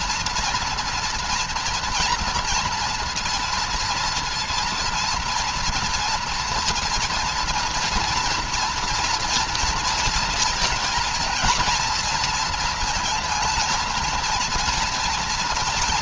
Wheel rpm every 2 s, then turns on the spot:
240, 230, 230, 230, 240, 230, 240, 240.
none